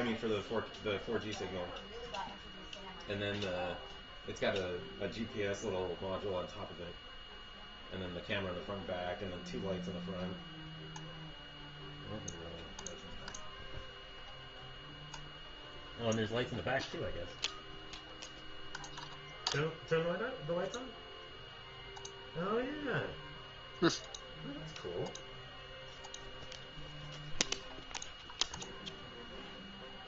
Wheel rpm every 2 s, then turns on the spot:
0, 0, 0, 0, 0, 0, 0, 0, 0, 0, 0, 0, 0, 0, 0.
none